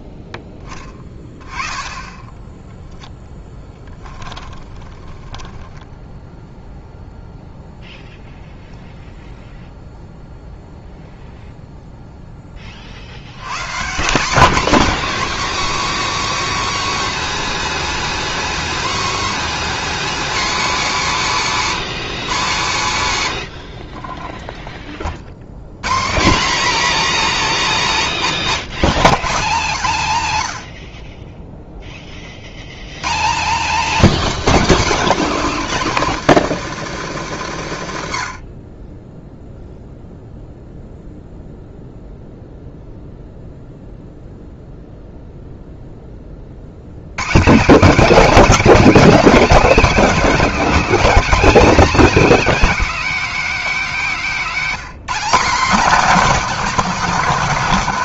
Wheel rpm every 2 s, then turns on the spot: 10, 10, 10, 0, 0, 0, 30, 250, 300, 290, 250, 140, 10, 240, 120, 90, 90, 220, 170, 30, 0, 0, 0, 70, 260, 260, 270, 210, 260.
2-6 54-56